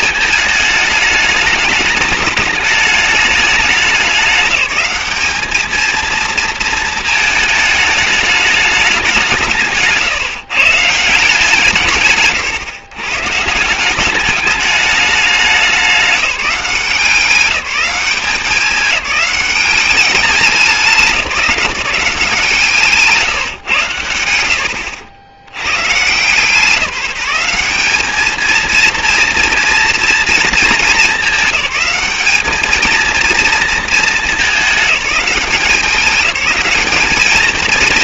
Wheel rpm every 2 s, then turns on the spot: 220, 210, 200, 220, 210, 140, 130, 210, 190, 200, 200, 160, 80, 160, 220, 220, 210, 210, 200.
none